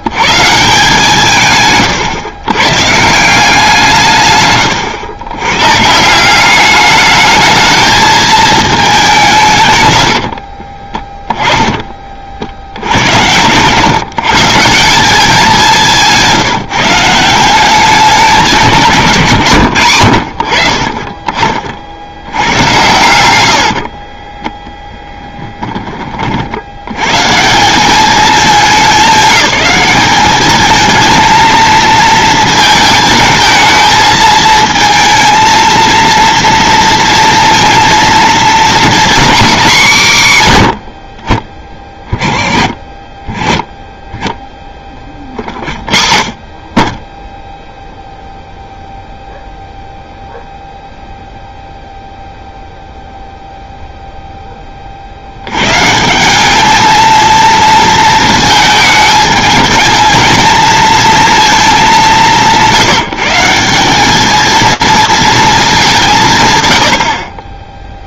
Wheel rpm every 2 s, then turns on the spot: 150, 140, 110, 200, 210, 20, 70, 170, 160, 170, 40, 100, 10, 80, 200, 230, 220, 220, 230, 250, 80, 30, 10, 30, 0, 0, 0, 30, 220, 220, 220, 170, 230, 90.
4-6 10-12 22-26